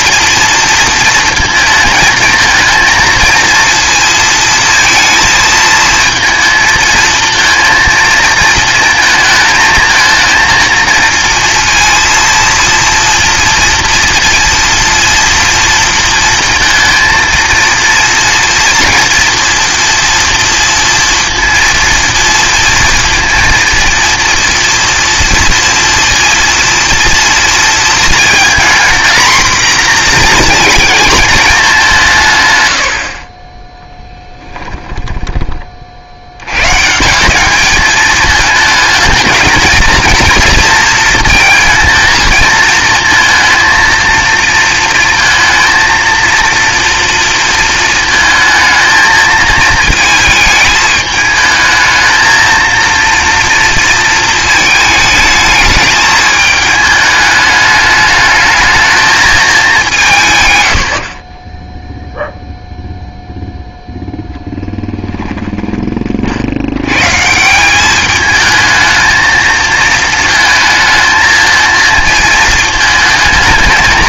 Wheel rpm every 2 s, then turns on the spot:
230, 220, 230, 220, 230, 230, 230, 230, 230, 240, 240, 230, 230, 230, 240, 230, 110, 20, 120, 220, 230, 230, 230, 230, 220, 210, 230, 220, 220, 210, 110, 0, 10, 80, 220, 220, 220.
34-36 64-66